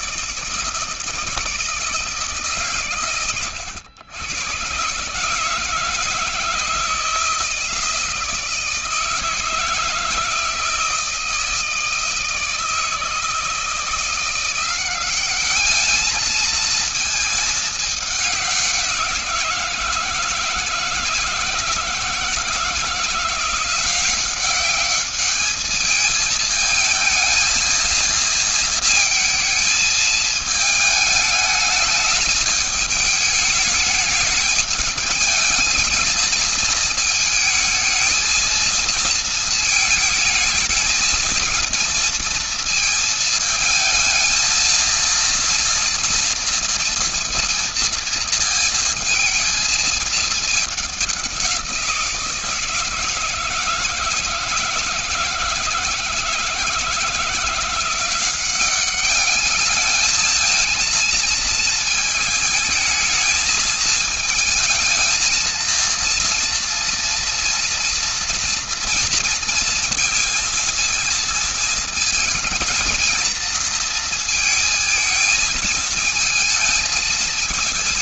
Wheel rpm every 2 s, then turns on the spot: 150, 150, 120, 160, 160, 160, 160, 170, 220, 190, 160, 170, 190, 220, 220, 220, 210, 210, 220, 220, 220, 230, 230, 230, 220, 210, 160, 160, 160, 190, 220, 220, 220, 230, 230, 230, 230, 230, 220.
none